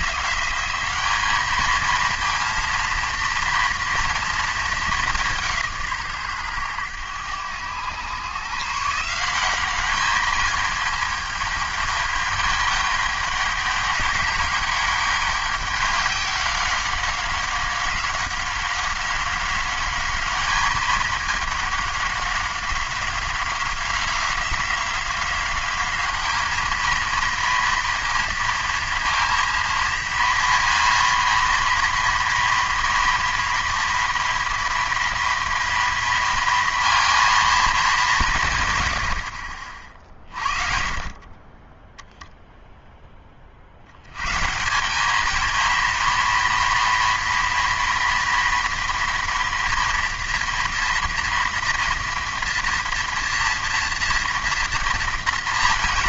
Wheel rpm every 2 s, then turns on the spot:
190, 230, 220, 110, 140, 210, 210, 200, 190, 190, 210, 190, 180, 220, 230, 230, 230, 230, 230, 130, 40, 0, 180, 230, 230, 230, 230, 230.
none